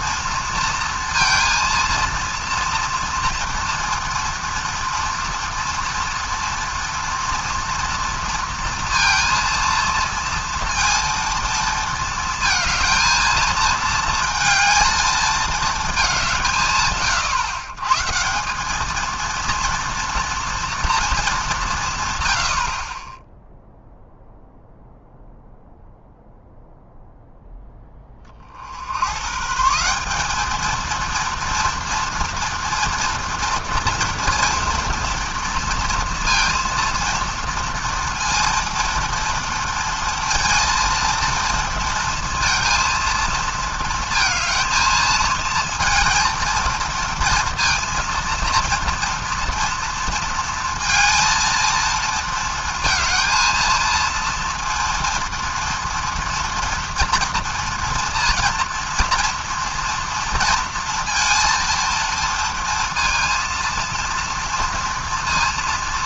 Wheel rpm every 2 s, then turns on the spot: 230, 230, 230, 230, 230, 230, 220, 220, 150, 200, 230, 40, 0, 0, 70, 230, 230, 230, 230, 230, 230, 230, 220, 230, 230, 230, 220, 230, 230, 230, 230, 230, 230.
none